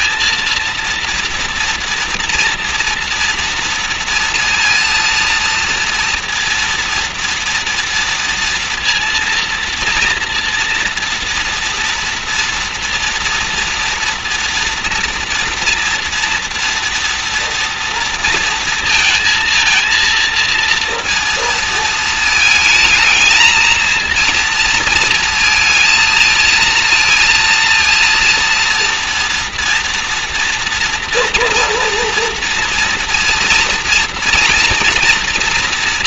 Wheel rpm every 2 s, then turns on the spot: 230, 230, 230, 230, 230, 230, 230, 230, 230, 230, 230, 220, 230, 230, 230, 230, 230, 230.
none